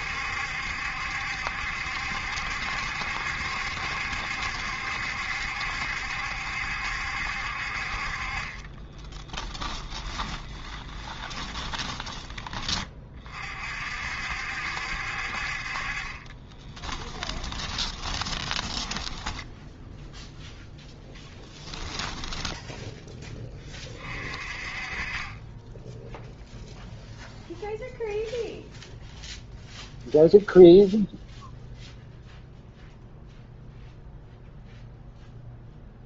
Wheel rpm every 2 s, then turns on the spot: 70, 70, 70, 70, 20, 20, 30, 60, 20, 10, 0, 10, 30, 0, 0, 0, 0, 0.
8-12 16-20